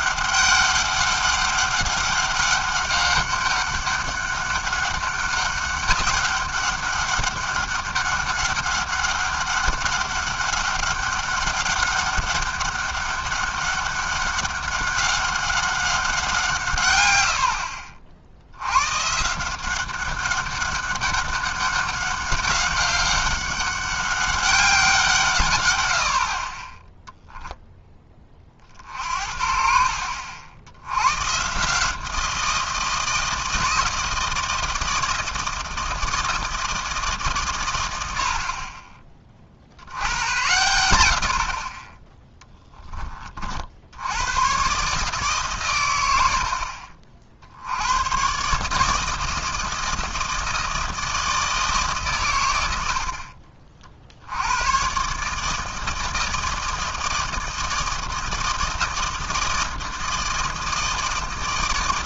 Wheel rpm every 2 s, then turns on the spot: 190, 200, 200, 200, 200, 200, 200, 200, 150, 90, 200, 190, 190, 20, 40, 80, 170, 160, 160, 30, 100, 10, 130, 50, 150, 160, 90, 100, 160, 160, 160.
none